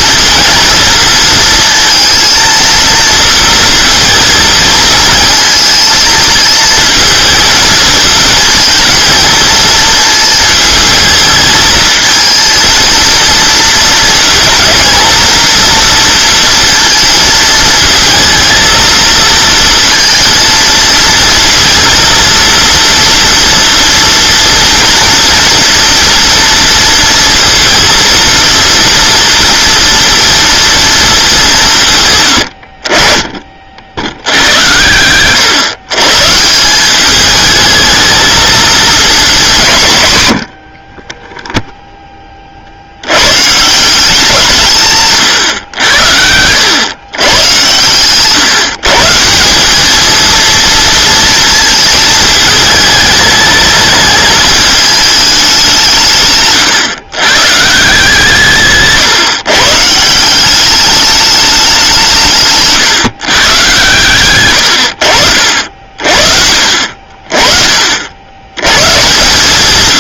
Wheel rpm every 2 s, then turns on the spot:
230, 230, 230, 220, 230, 220, 230, 220, 230, 230, 230, 230, 240, 230, 230, 230, 70, 100, 180, 230, 50, 60, 150, 120, 140, 230, 210, 210, 130, 140, 200, 150, 100, 50, 110.
none